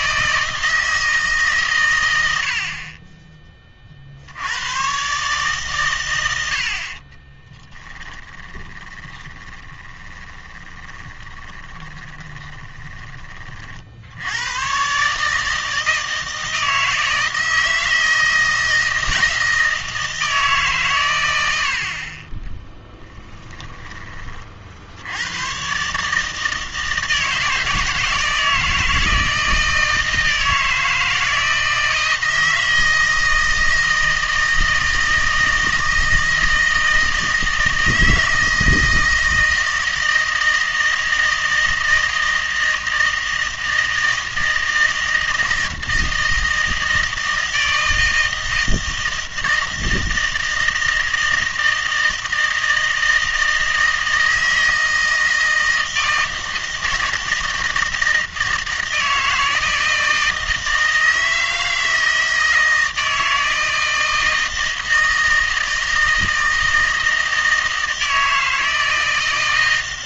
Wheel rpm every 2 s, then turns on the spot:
160, 50, 100, 60, 20, 20, 20, 110, 160, 160, 140, 10, 50, 160, 160, 160, 160, 160, 160, 160, 160, 160, 160, 160, 160, 160, 160, 160, 160, 160, 160, 160, 160, 160, 160.
8-14 22-24